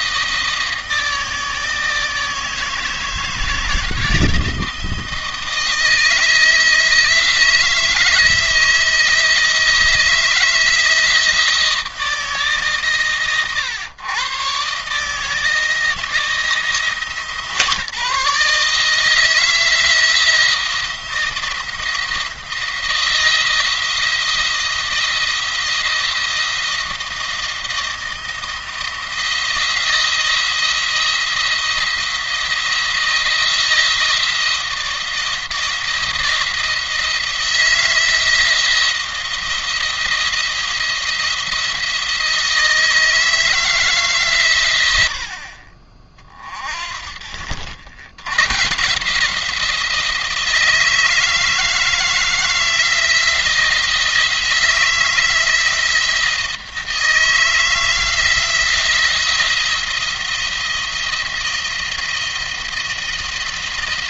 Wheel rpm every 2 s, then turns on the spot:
160, 160, 160, 160, 160, 160, 140, 140, 160, 150, 170, 170, 170, 170, 160, 170, 170, 160, 160, 170, 170, 160, 110, 40, 140, 160, 170, 160, 170, 170, 170, 170.
none